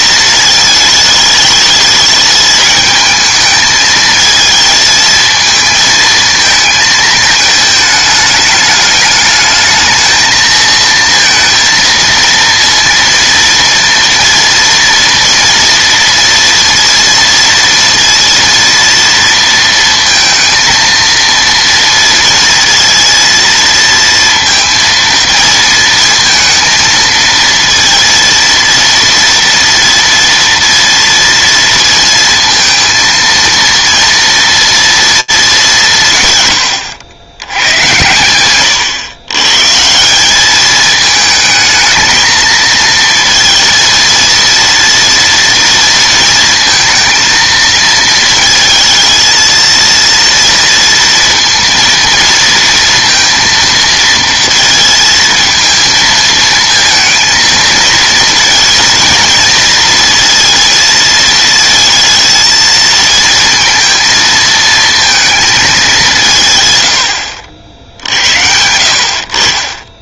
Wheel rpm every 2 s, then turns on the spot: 220, 210, 220, 220, 210, 230, 230, 230, 230, 230, 230, 230, 230, 230, 230, 230, 230, 230, 100, 120, 210, 230, 230, 230, 220, 230, 230, 230, 220, 230, 230, 220, 220, 120, 70.
38-40